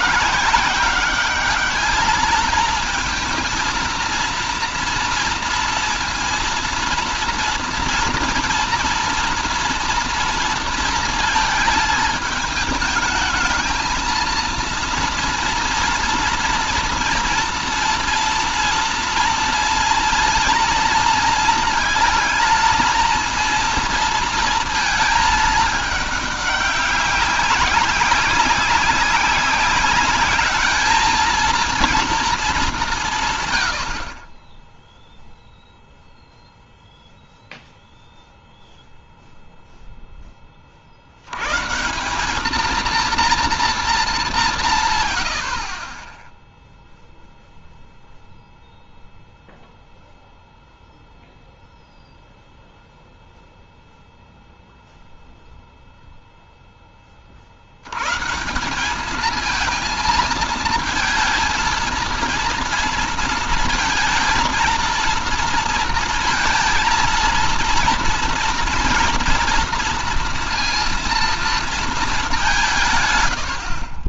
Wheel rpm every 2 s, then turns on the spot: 230, 230, 230, 230, 220, 220, 230, 230, 230, 230, 230, 220, 190, 190, 220, 170, 0, 0, 0, 10, 210, 200, 20, 0, 0, 0, 0, 0, 30, 210, 220, 230, 230, 230, 230, 230, 120.
44-46